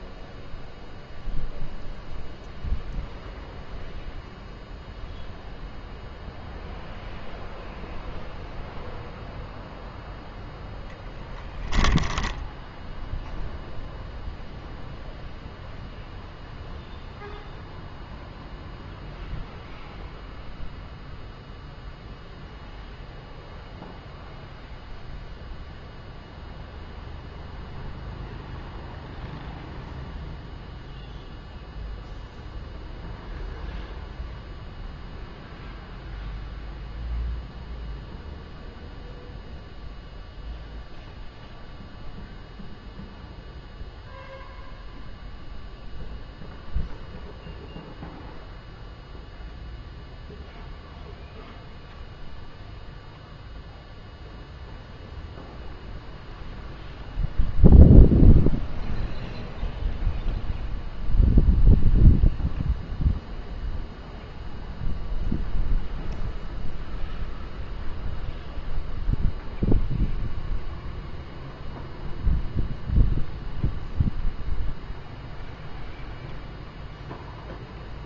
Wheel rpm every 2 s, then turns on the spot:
0, 0, 0, 0, 0, 0, 0, 0, 0, 0, 0, 0, 0, 0, 0, 0, 0, 0, 0, 0, 0, 0, 0, 0, 0, 0, 0, 0, 0, 0, 0, 0, 0, 0, 0, 0, 0, 0, 0.
none